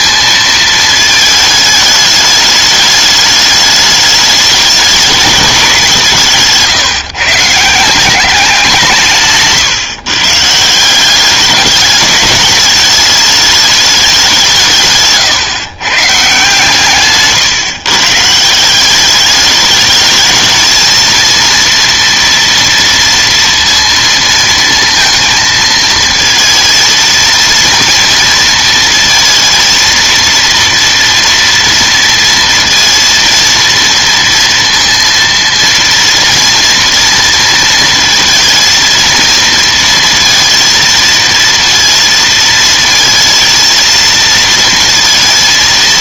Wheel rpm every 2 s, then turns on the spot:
220, 210, 210, 150, 180, 170, 200, 160, 150, 180, 220, 230, 230, 230, 230, 230, 230, 230, 230, 230, 230, 230, 230.
none